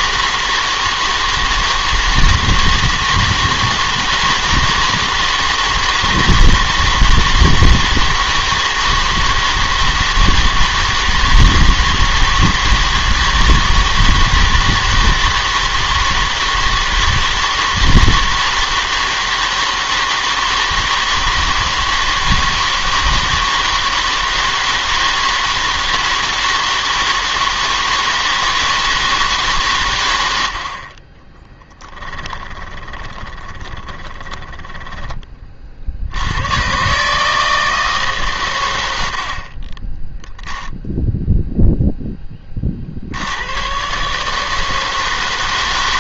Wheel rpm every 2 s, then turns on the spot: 160, 160, 160, 160, 160, 160, 160, 160, 160, 160, 160, 160, 160, 160, 160, 60, 10, 10, 120, 100, 0, 30, 160.
32-34